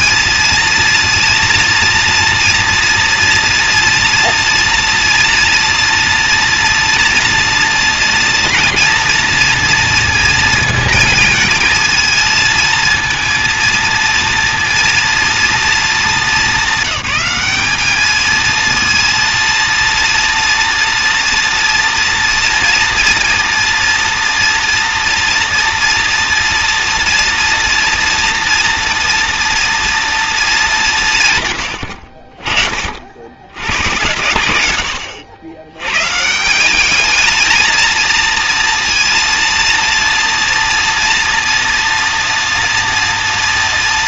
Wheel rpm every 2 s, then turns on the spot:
230, 230, 240, 230, 240, 230, 220, 230, 190, 220, 230, 230, 230, 240, 230, 180, 40, 110, 180, 230, 230, 240.
none